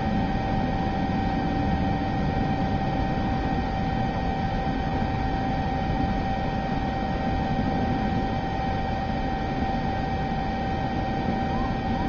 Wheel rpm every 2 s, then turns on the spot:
0, 0, 0, 0, 0, 0.
none